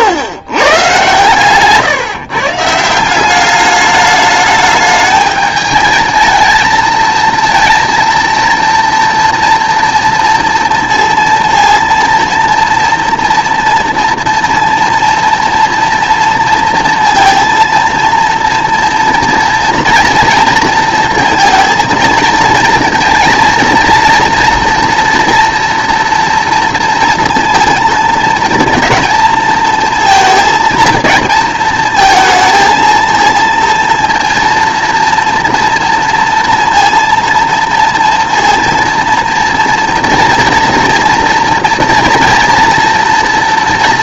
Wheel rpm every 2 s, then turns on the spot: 120, 150, 210, 220, 230, 230, 230, 230, 230, 230, 230, 230, 230, 230, 230, 230, 230, 230, 230, 230, 230, 230.
none